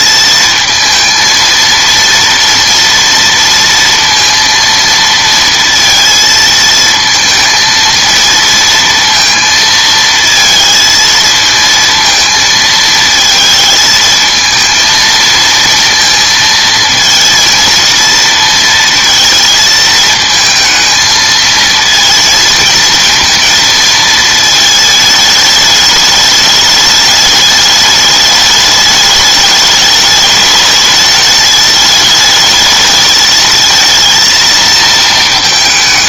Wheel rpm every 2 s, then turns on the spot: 230, 230, 230, 220, 230, 220, 230, 220, 220, 230, 220, 230, 220, 210, 210, 210, 210, 230.
none